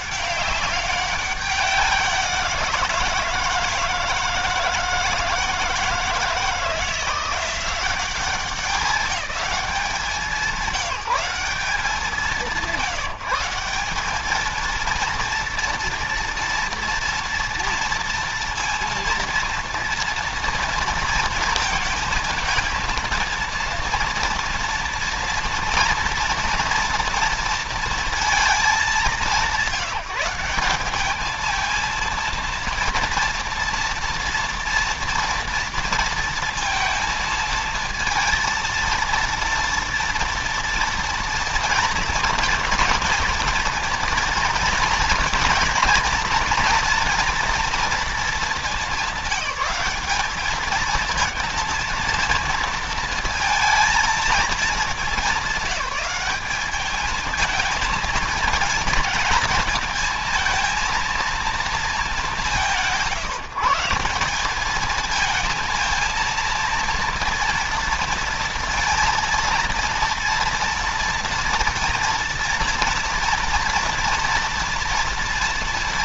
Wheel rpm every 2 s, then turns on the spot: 200, 180, 160, 160, 200, 190, 190, 220, 230, 230, 230, 230, 230, 240, 220, 190, 230, 230, 230, 230, 230, 230, 240, 240, 210, 210, 230, 220, 200, 220, 230, 190, 200, 230, 230, 230, 230, 230.
none